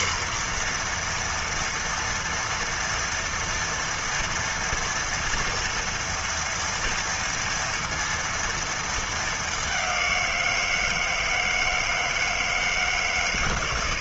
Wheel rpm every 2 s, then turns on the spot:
240, 240, 240, 230, 230, 180, 160.
none